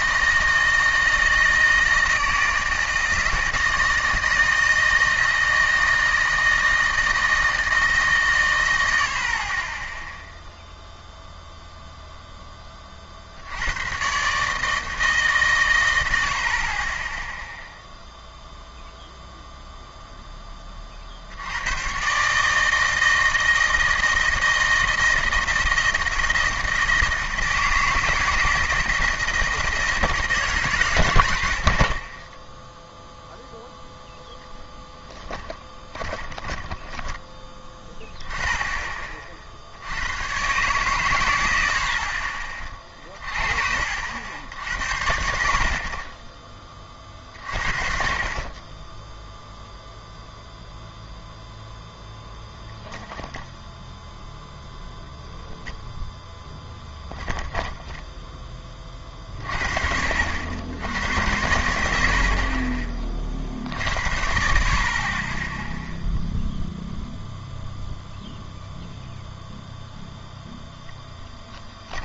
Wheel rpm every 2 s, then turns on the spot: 160, 160, 160, 160, 110, 0, 10, 150, 40, 0, 20, 150, 160, 160, 160, 140, 10, 0, 10, 20, 140, 30, 80, 20, 30, 0, 0, 0, 10, 20, 70, 40, 70, 0, 0, 0.
36-38